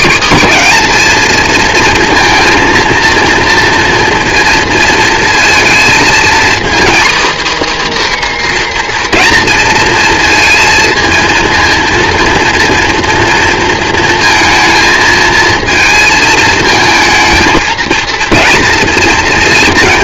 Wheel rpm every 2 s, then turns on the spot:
240, 230, 230, 260, 260, 230, 230, 220, 220, 230.
none